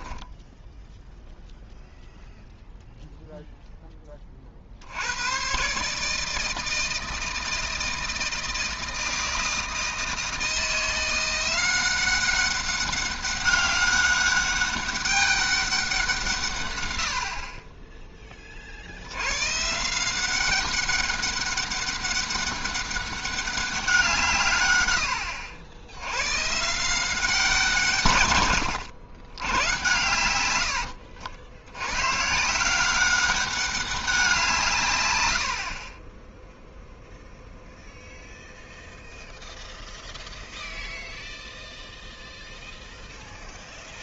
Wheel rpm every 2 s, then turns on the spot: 0, 0, 50, 160, 160, 160, 190, 200, 140, 50, 190, 200, 130, 150, 120, 100, 160, 160, 0, 0, 0, 0.
none